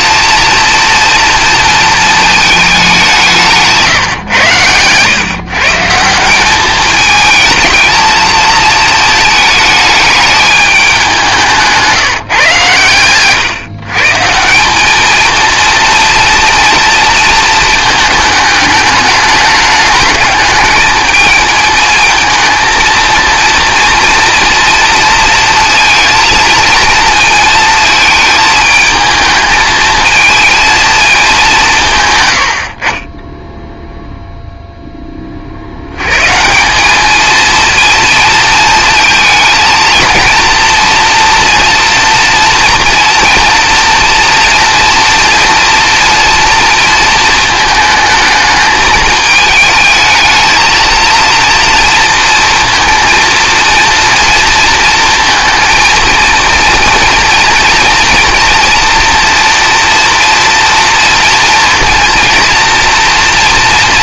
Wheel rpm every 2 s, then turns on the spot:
240, 200, 110, 210, 220, 200, 130, 190, 230, 210, 220, 230, 230, 230, 220, 220, 40, 10, 200, 230, 230, 230, 230, 230, 220, 230, 230, 230, 230, 230, 230, 240.
none